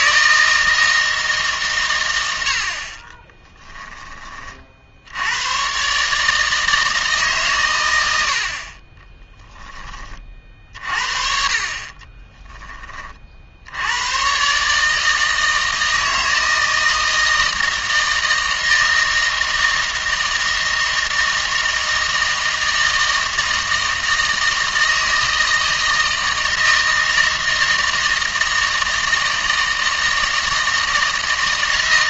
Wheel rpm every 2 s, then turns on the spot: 160, 60, 50, 160, 60, 40, 20, 140, 160, 160, 160, 160, 160, 160, 160, 160.
none